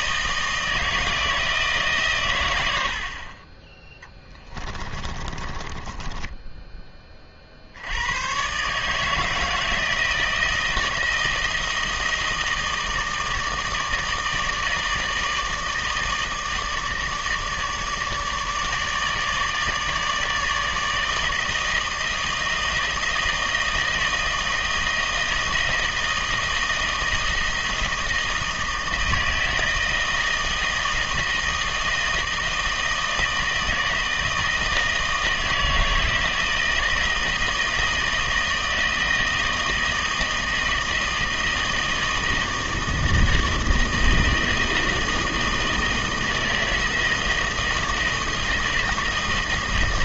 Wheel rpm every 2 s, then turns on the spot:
160, 90, 20, 10, 130, 160, 160, 160, 160, 150, 160, 160, 160, 160, 160, 160, 160, 160, 160, 160, 160, 160, 160, 160, 160.
4-6